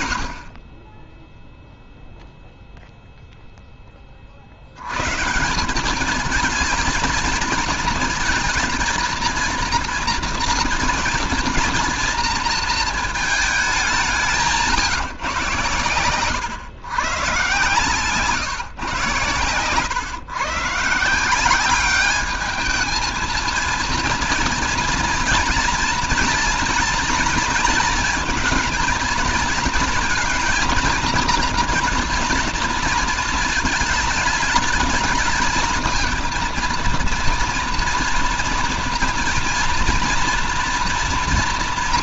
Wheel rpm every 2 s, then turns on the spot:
40, 0, 70, 220, 230, 230, 230, 170, 130, 130, 140, 210, 230, 230, 220, 230, 230, 220, 230, 230, 240.
none